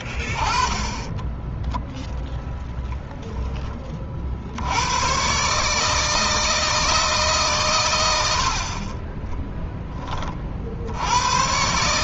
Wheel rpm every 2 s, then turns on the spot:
20, 0, 90, 160, 60, 60.
0-2